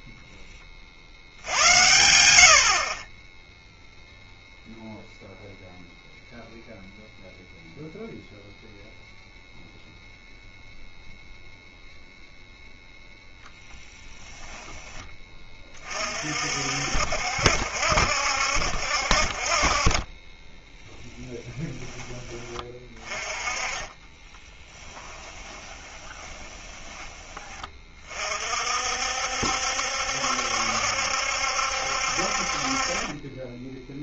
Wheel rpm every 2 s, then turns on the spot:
20, 60, 0, 0, 0, 0, 0, 10, 60, 70, 10, 20, 10, 20, 50, 70, 40.
24-28